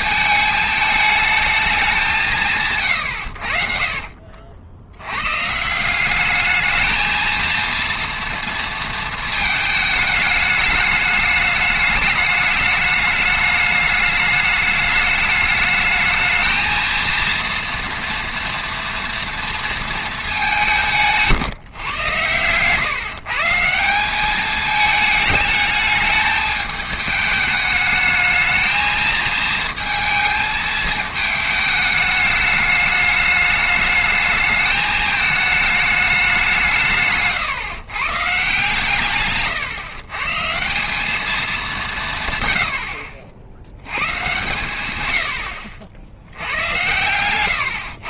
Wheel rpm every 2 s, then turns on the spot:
220, 160, 60, 210, 230, 210, 210, 210, 220, 230, 200, 120, 200, 210, 220, 230, 210, 220, 180, 150, 160, 80, 120, 90.
none